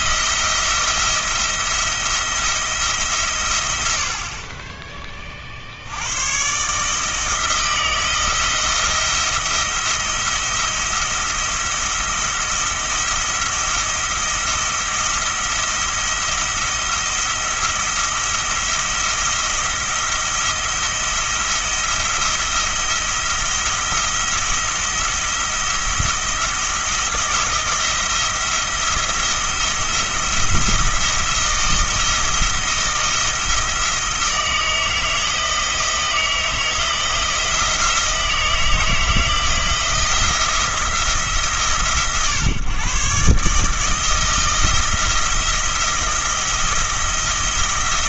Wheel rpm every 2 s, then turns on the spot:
170, 160, 30, 150, 170, 170, 170, 170, 170, 170, 170, 170, 170, 170, 170, 170, 170, 170, 170, 160, 160, 130, 170, 170.
none